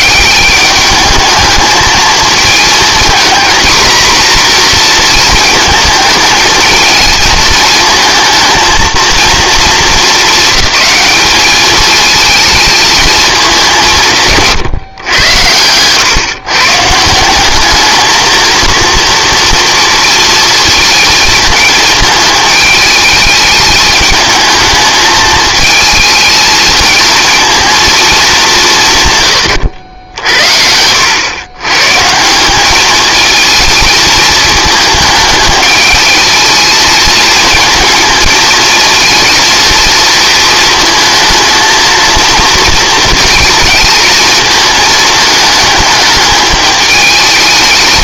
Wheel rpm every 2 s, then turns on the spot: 200, 220, 240, 220, 220, 210, 220, 140, 140, 230, 230, 210, 220, 220, 180, 80, 190, 220, 220, 220, 230, 230, 220, 210.
30-32